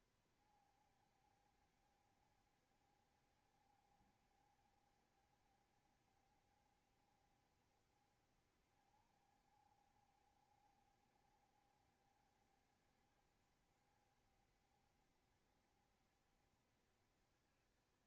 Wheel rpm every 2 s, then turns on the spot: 70, 70, 70, 70, 60, 70, 70, 70, 70.
none